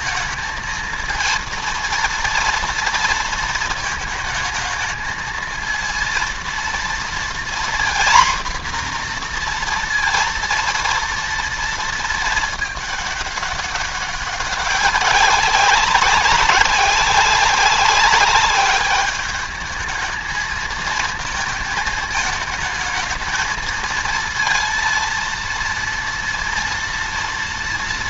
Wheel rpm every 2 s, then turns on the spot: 230, 230, 220, 230, 240, 230, 210, 200, 190, 200, 220, 220, 230, 230.
none